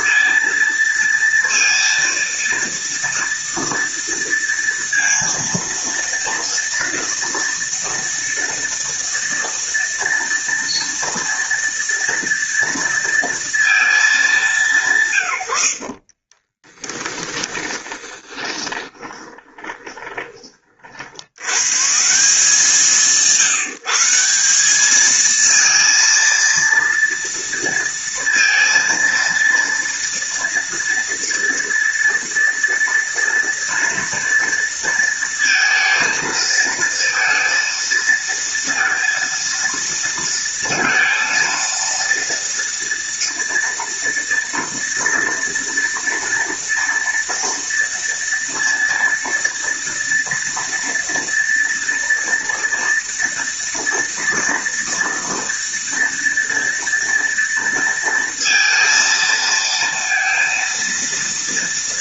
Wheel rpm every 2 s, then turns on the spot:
230, 230, 230, 240, 230, 230, 230, 160, 20, 20, 80, 170, 220, 230, 230, 230, 230, 230, 230, 230, 230, 230, 230, 230, 230, 230, 230, 230, 230, 230, 230.
16-20